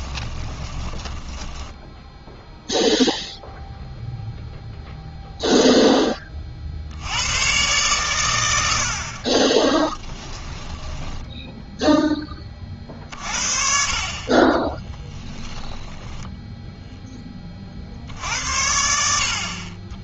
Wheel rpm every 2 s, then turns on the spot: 20, 0, 0, 40, 90, 10, 30, 20, 10, 80.
0-2 10-12 14-16